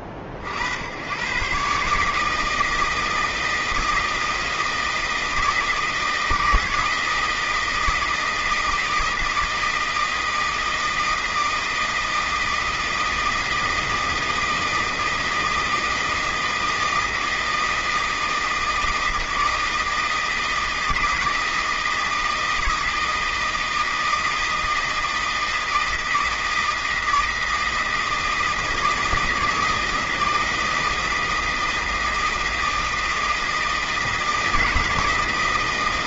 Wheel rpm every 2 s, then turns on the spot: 70, 150, 160, 160, 160, 160, 160, 160, 160, 160, 160, 160, 160, 160, 160, 160, 160, 160.
none